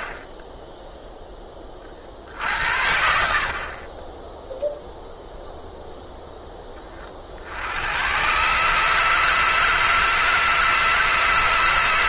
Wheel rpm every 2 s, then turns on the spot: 10, 60, 0, 20, 140, 150.
none